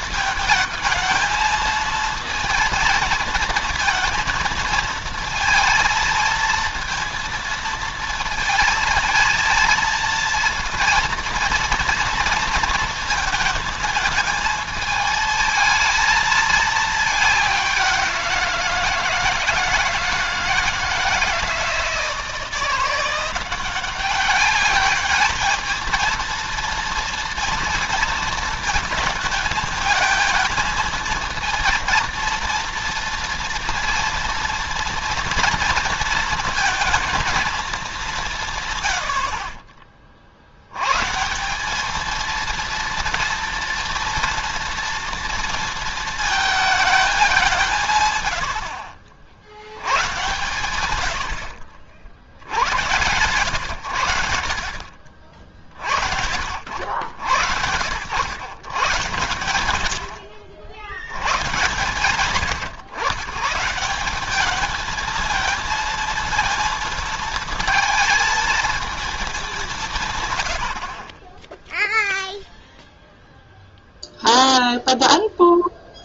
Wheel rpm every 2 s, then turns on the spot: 220, 220, 230, 230, 220, 230, 230, 220, 220, 170, 160, 160, 200, 230, 220, 220, 230, 240, 230, 130, 80, 230, 230, 220, 70, 120, 90, 80, 60, 110, 70, 120, 210, 220, 220, 90, 0, 0.
48-50